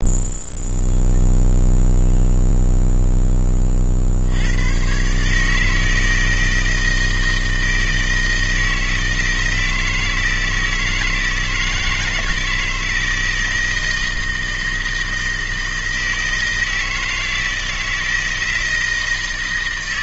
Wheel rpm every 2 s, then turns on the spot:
0, 0, 110, 160, 160, 160, 160, 160, 160, 160.
none